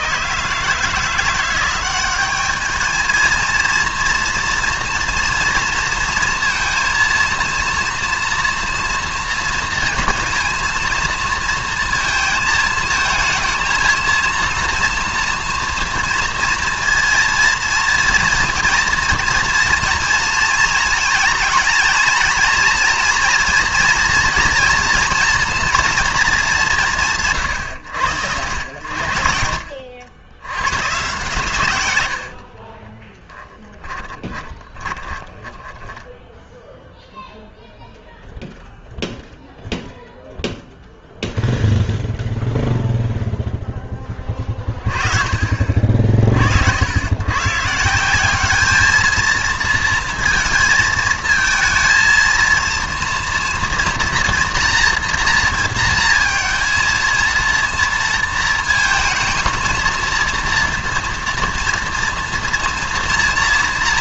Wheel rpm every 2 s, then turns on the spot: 150, 210, 230, 230, 230, 230, 230, 230, 230, 230, 230, 230, 240, 200, 90, 100, 40, 20, 0, 0, 0, 0, 20, 70, 210, 230, 230, 240, 230, 220, 230, 230.
32-36